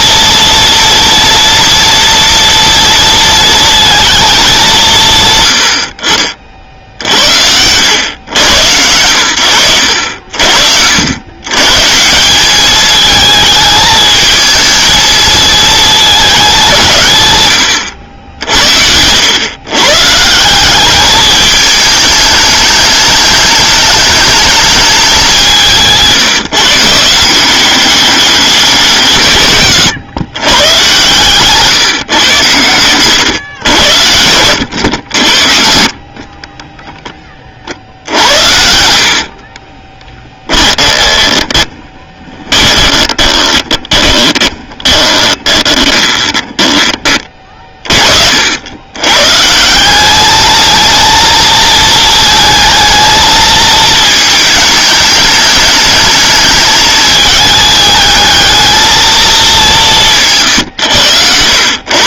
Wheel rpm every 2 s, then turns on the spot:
240, 230, 200, 50, 110, 70, 200, 220, 190, 80, 170, 210, 210, 150, 190, 120, 110, 80, 30, 70, 20, 30, 20, 20, 80, 220, 220, 220, 210, 220, 130.
36-48